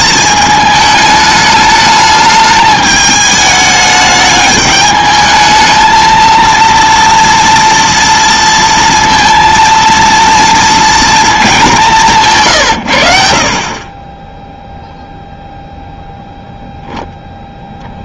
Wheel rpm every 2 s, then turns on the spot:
210, 210, 210, 230, 230, 230, 120, 0, 0.
none